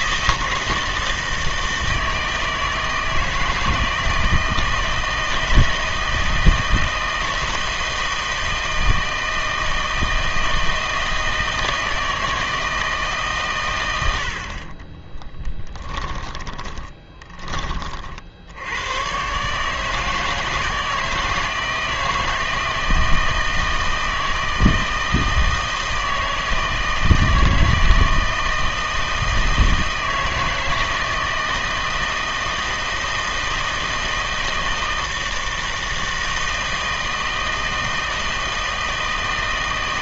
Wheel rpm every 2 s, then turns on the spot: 160, 160, 160, 160, 160, 160, 160, 40, 20, 80, 160, 160, 160, 160, 160, 160, 160, 160, 160, 160.
16-18